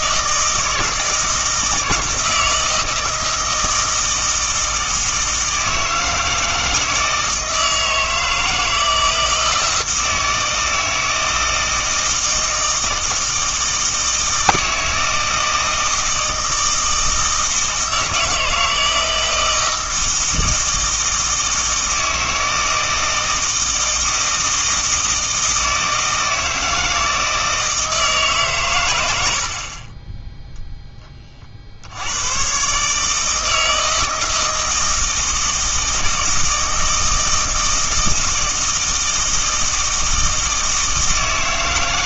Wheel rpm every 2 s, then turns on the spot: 160, 160, 160, 160, 160, 160, 160, 160, 160, 160, 160, 160, 160, 160, 130, 0, 130, 160, 160, 160, 160.
none